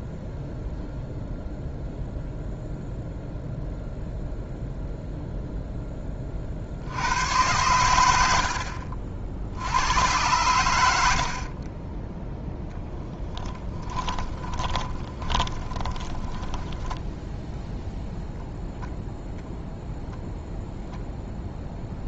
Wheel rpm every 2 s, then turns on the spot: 0, 0, 0, 70, 50, 90, 10, 20, 10, 0, 0.
8-10 14-18